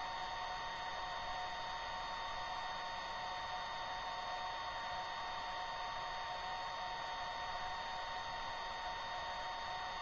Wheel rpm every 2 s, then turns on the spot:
0, 0, 0, 0, 0.
none